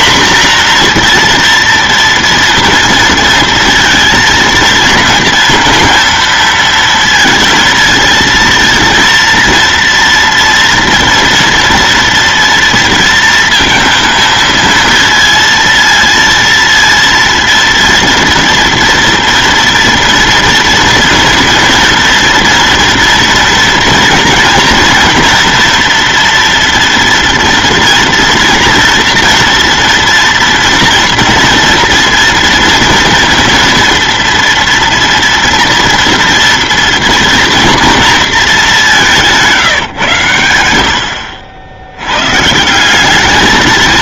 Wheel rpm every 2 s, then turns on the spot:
240, 230, 230, 230, 230, 230, 230, 230, 230, 230, 230, 230, 230, 230, 230, 230, 230, 230, 230, 200, 80, 180.
40-42